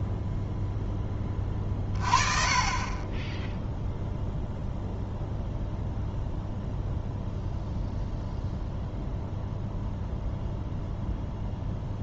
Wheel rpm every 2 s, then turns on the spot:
0, 30, 0, 0, 0, 0.
none